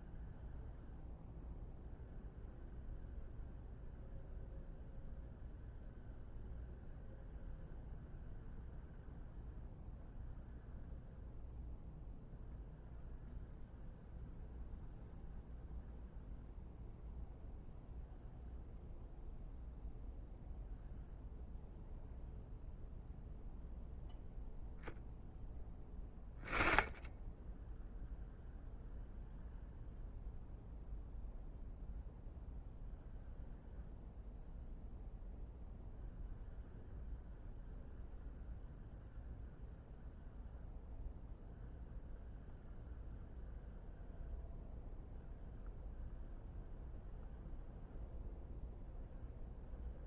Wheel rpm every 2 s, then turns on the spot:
0, 0, 0, 0, 0, 0, 0, 0, 0, 0, 0, 0, 0, 10, 0, 0, 0, 0, 0, 0, 0, 0, 0, 0, 0.
none